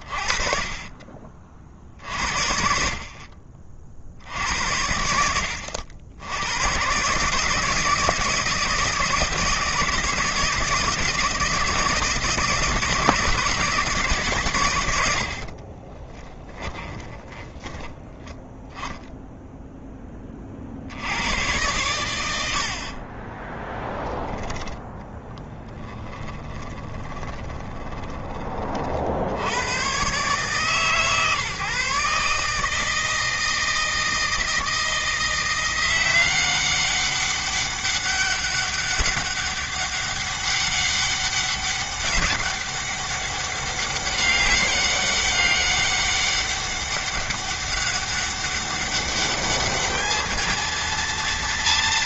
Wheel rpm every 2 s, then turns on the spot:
40, 60, 80, 120, 170, 160, 160, 90, 10, 0, 80, 40, 20, 20, 60, 140, 160, 170, 200, 200, 200, 200, 200, 200, 200, 230.
14-18 22-28